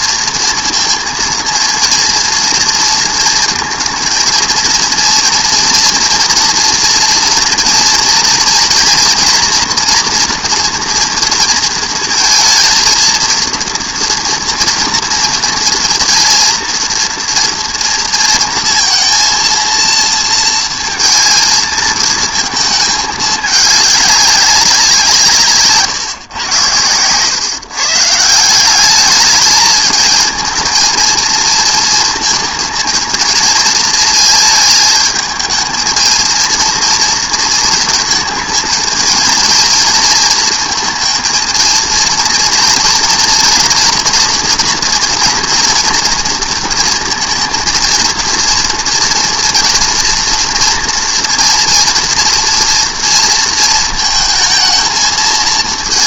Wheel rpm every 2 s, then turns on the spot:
230, 230, 230, 230, 240, 230, 220, 230, 230, 230, 230, 220, 180, 110, 190, 230, 230, 220, 230, 230, 230, 230, 230, 230, 230, 230, 230, 220.
none